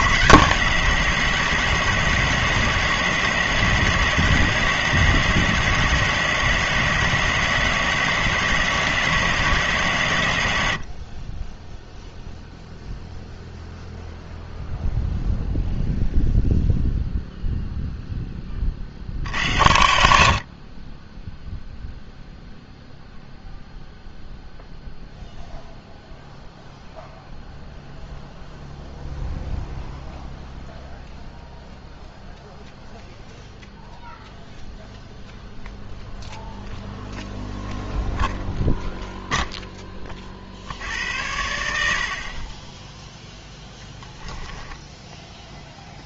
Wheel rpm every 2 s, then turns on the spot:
180, 170, 180, 170, 180, 70, 0, 0, 0, 50, 30, 0, 0, 0, 0, 0, 0, 0, 0, 0, 70, 20, 10.
44-46